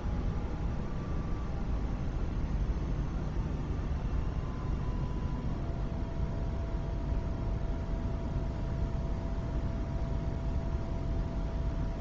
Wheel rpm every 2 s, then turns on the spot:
0, 0, 0, 0, 0, 0.
none